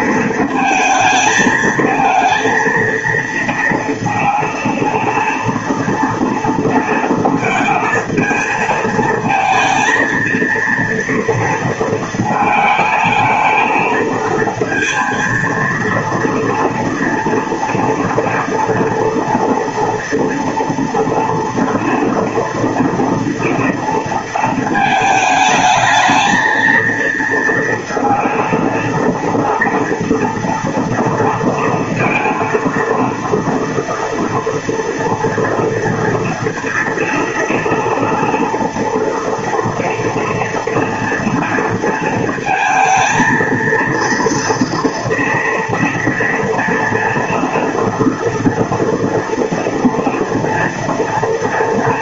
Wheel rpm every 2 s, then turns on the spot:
220, 230, 230, 230, 230, 230, 220, 230, 230, 230, 240, 230, 220, 230, 230, 230, 230, 230, 230, 240, 230, 220, 230, 230, 230, 230.
none